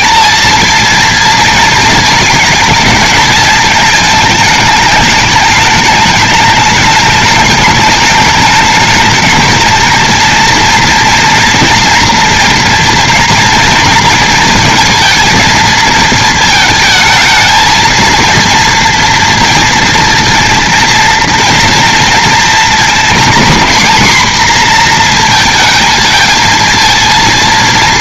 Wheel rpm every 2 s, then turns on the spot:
230, 220, 210, 210, 220, 230, 230, 230, 220, 230, 230, 230, 250, 230.
none